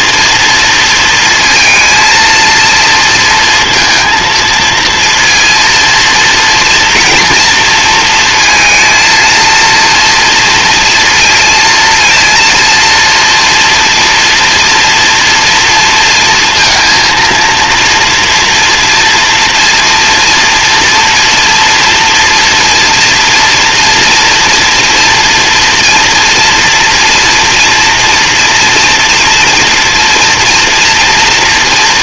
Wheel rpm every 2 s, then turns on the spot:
230, 230, 230, 230, 230, 230, 230, 240, 230, 230, 240, 230, 230, 240, 230, 230.
none